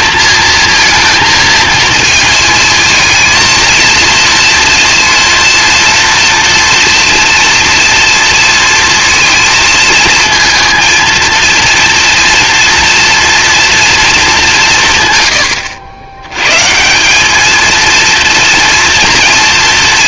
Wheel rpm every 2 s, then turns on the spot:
230, 220, 230, 230, 230, 230, 230, 180, 150, 230.
none